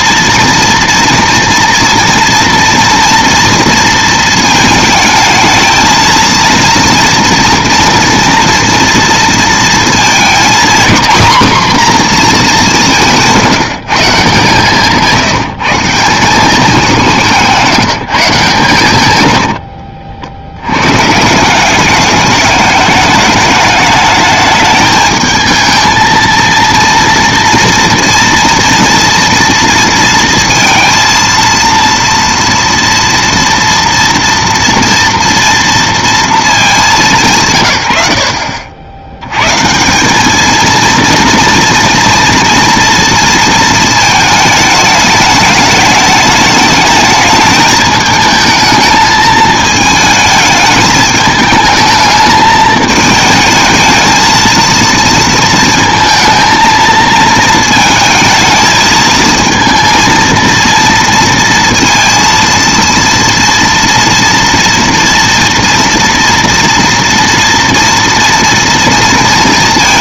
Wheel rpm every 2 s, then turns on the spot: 230, 230, 220, 230, 230, 240, 210, 160, 200, 130, 90, 210, 210, 230, 230, 230, 230, 230, 190, 50, 230, 230, 210, 220, 220, 220, 210, 220, 230, 220, 230, 230, 230, 230, 230.
14-16